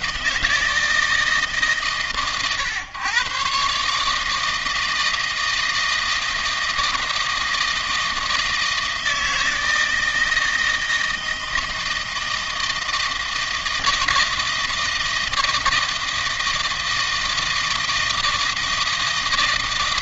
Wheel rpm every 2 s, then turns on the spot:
160, 130, 160, 160, 160, 160, 160, 160, 160, 160.
none